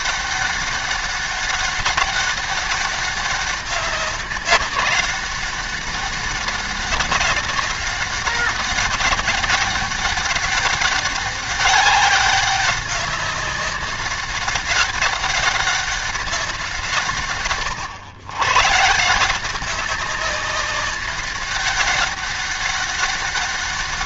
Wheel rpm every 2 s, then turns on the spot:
200, 200, 190, 200, 200, 200, 200, 200, 180, 130, 200, 200.
none